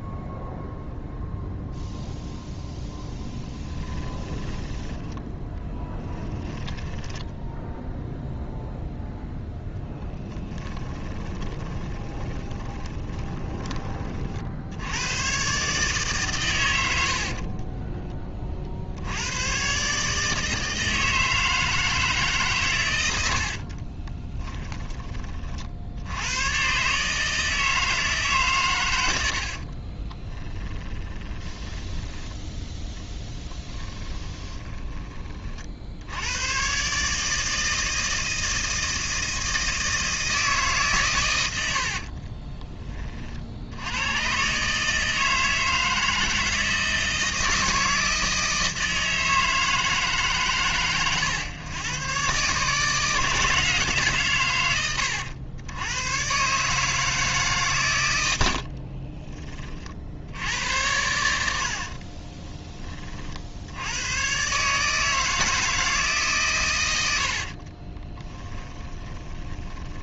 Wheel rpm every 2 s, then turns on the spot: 0, 0, 20, 10, 0, 10, 20, 80, 100, 50, 160, 120, 20, 130, 110, 10, 10, 20, 130, 160, 140, 20, 140, 160, 160, 120, 150, 100, 150, 60, 90, 20, 150, 110, 20.
4-8 10-14 30-32 34-36 58-60 68-70